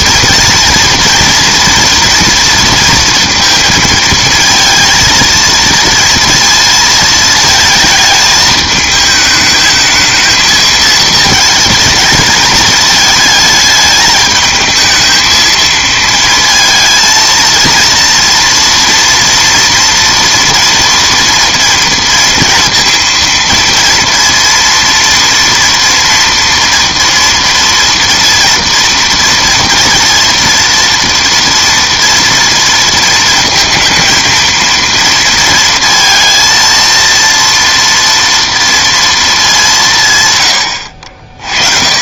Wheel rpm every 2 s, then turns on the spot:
230, 230, 230, 230, 220, 220, 220, 220, 220, 230, 230, 230, 230, 240, 240, 230, 230, 230, 230, 230, 100.
none